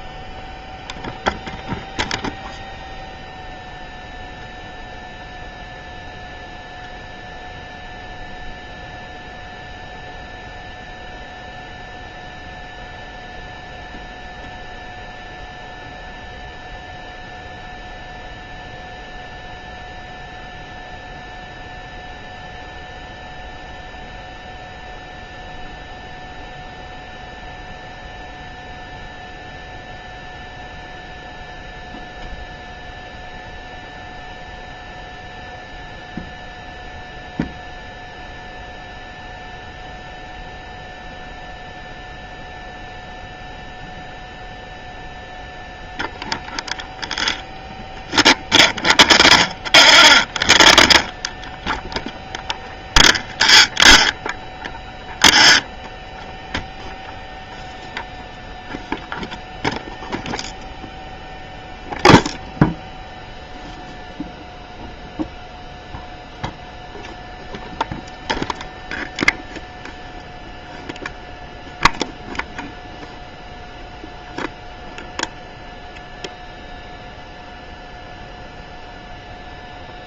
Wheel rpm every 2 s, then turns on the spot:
0, 0, 0, 0, 0, 0, 0, 0, 0, 0, 0, 0, 0, 0, 0, 0, 0, 0, 0, 0, 0, 0, 0, 0, 0, 0, 0, 0, 0, 0, 0, 0, 0, 0, 0, 0, 0, 0, 0, 0.
none